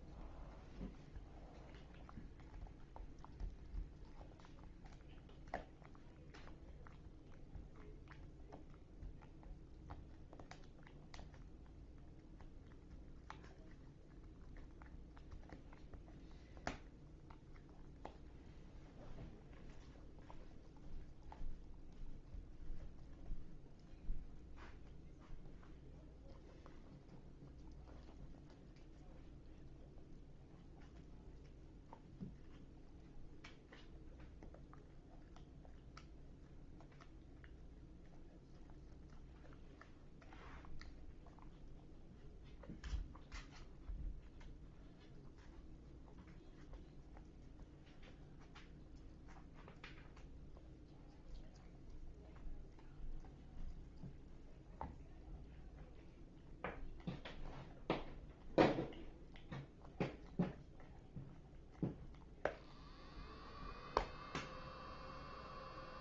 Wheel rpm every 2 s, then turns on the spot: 0, 0, 0, 0, 0, 0, 0, 0, 0, 0, 0, 0, 0, 0, 0, 0, 0, 0, 0, 0, 0, 0, 0, 0, 0, 0, 0, 0, 0, 0, 0, 0, 0.
none